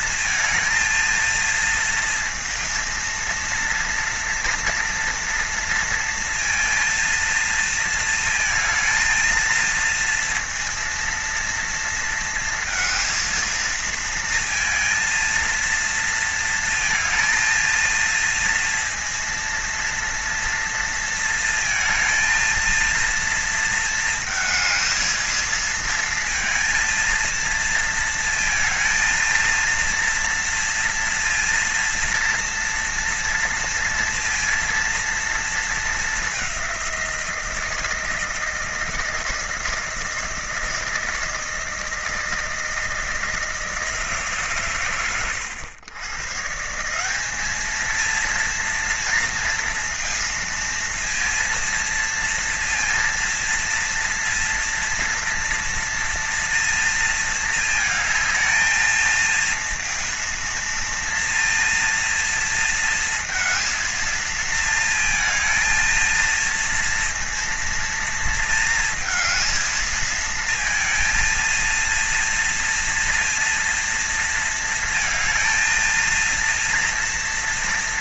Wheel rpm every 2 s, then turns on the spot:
230, 230, 230, 230, 230, 230, 230, 230, 230, 240, 230, 230, 220, 230, 220, 230, 240, 230, 190, 160, 160, 160, 130, 160, 230, 230, 230, 230, 230, 230, 230, 230, 230, 230, 230, 230, 230, 230, 230.
none